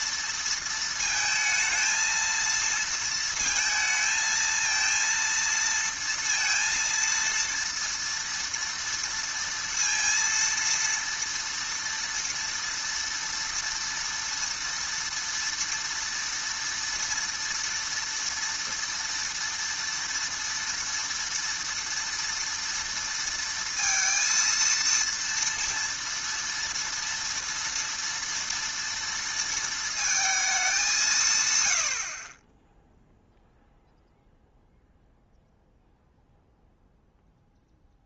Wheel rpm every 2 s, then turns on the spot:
230, 230, 230, 230, 230, 230, 230, 230, 240, 230, 230, 230, 230, 230, 230, 210, 20, 0, 0.
none